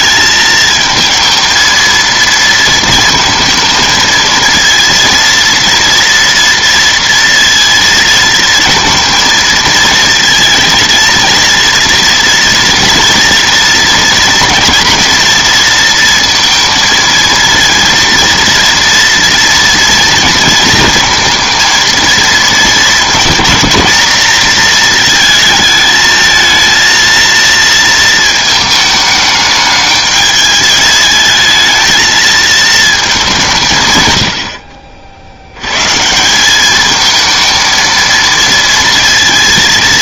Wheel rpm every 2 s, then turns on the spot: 230, 230, 230, 230, 230, 230, 230, 230, 230, 230, 230, 220, 220, 230, 220, 210, 220, 50, 210, 230.
none